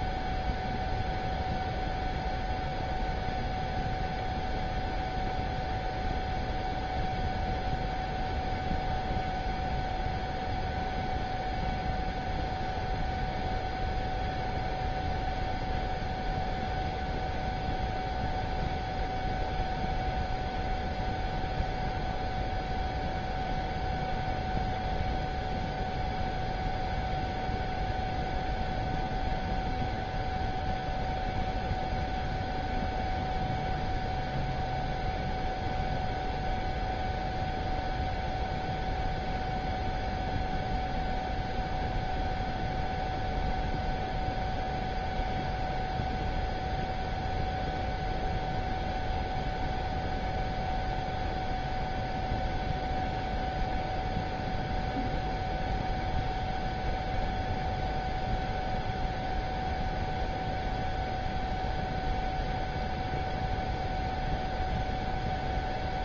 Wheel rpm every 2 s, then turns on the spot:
0, 0, 0, 0, 0, 0, 0, 0, 0, 0, 0, 0, 0, 0, 0, 0, 0, 0, 0, 0, 0, 0, 0, 0, 0, 0, 0, 0, 0, 0, 0, 0, 0.
none